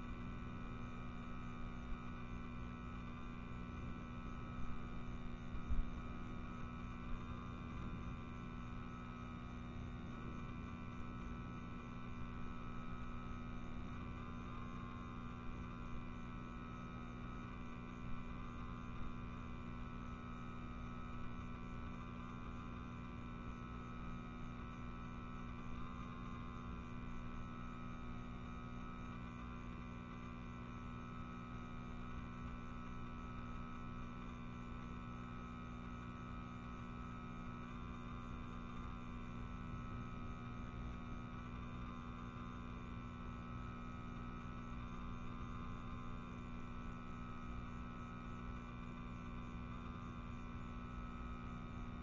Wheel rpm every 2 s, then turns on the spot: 0, 0, 0, 0, 0, 0, 0, 0, 0, 0, 0, 0, 0, 0, 0, 0, 0, 0, 0, 0, 0, 0, 0, 0, 0, 0.
none